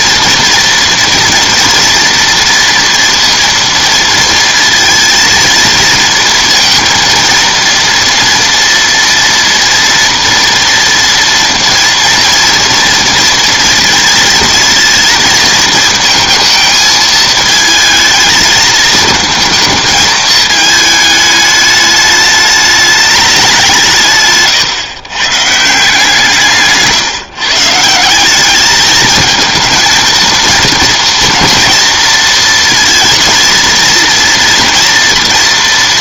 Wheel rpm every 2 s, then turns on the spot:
240, 230, 230, 230, 230, 240, 230, 230, 220, 220, 220, 210, 130, 140, 210, 230, 230, 230.
none